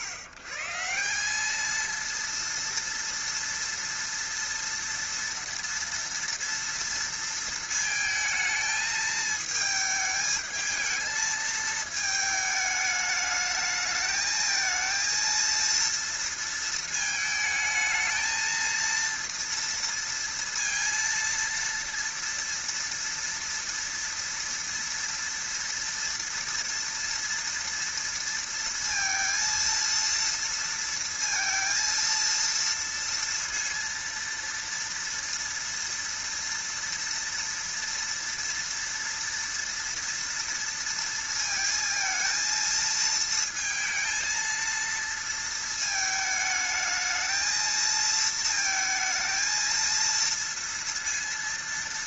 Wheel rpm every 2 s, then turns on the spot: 130, 230, 230, 230, 220, 220, 210, 220, 230, 230, 230, 230, 230, 230, 230, 230, 230, 230, 230, 230, 230, 220, 230, 220, 220, 230.
none